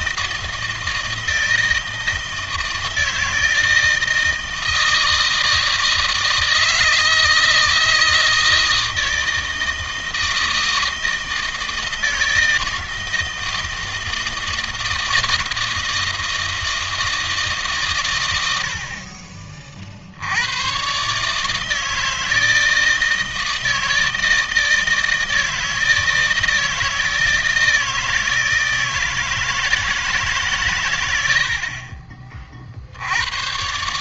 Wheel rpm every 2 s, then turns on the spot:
160, 160, 160, 160, 160, 160, 160, 160, 160, 80, 110, 160, 160, 160, 160, 130, 50.
none